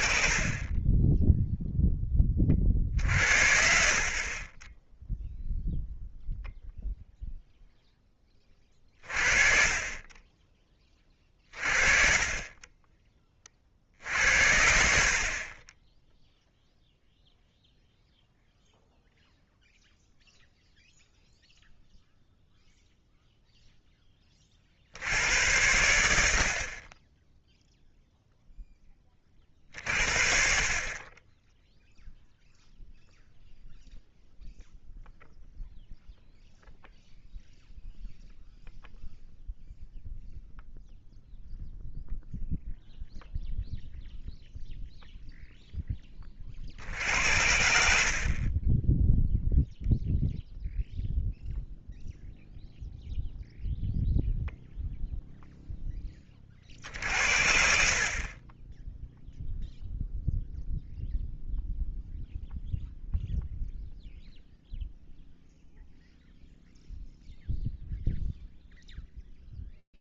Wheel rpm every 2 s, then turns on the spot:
20, 60, 10, 0, 30, 30, 10, 70, 0, 0, 0, 0, 40, 50, 10, 40, 0, 0, 0, 0, 0, 0, 0, 40, 30, 0, 0, 0, 30, 30, 0, 0, 0, 0, 0.
none